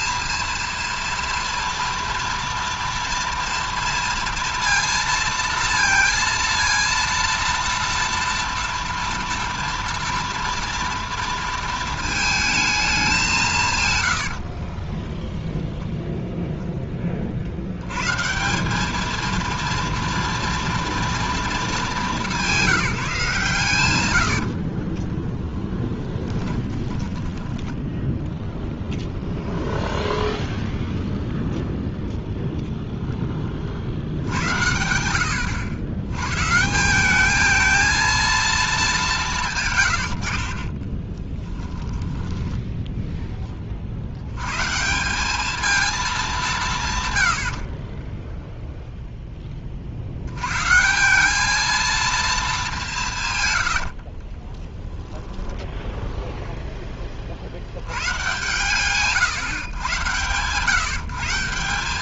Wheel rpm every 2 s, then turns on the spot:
230, 230, 230, 230, 230, 230, 220, 40, 10, 190, 230, 180, 50, 10, 0, 0, 0, 90, 190, 190, 20, 30, 190, 110, 10, 180, 140, 0, 30, 140, 170.
14-16 24-28 40-44 52-54